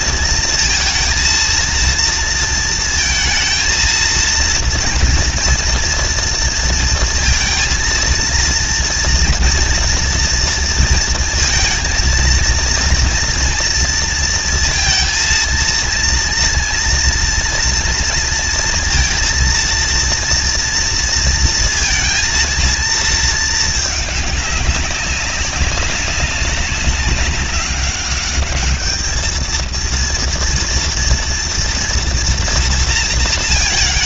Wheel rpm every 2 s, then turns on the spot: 230, 230, 230, 230, 230, 230, 230, 230, 230, 230, 230, 230, 210, 190, 200, 230, 230.
none